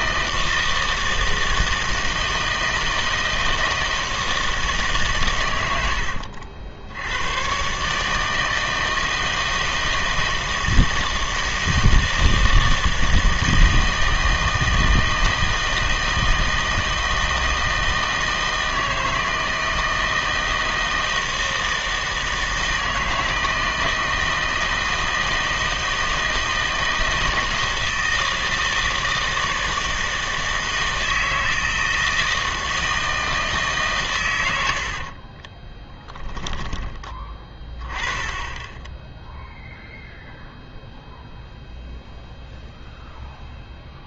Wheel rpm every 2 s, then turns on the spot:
160, 160, 150, 70, 160, 160, 160, 160, 160, 160, 160, 160, 160, 160, 160, 160, 160, 80, 10, 10, 0, 0.
34-36